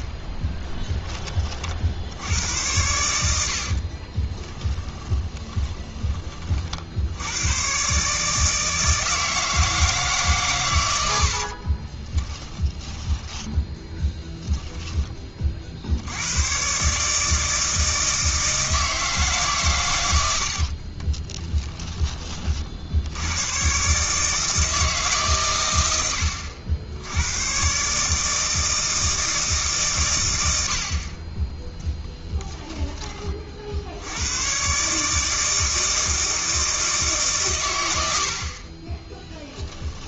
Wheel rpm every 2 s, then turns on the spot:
10, 90, 20, 60, 160, 110, 10, 10, 130, 160, 50, 60, 150, 70, 160, 60, 10, 130, 160, 40.
4-6 12-14 20-22 38-40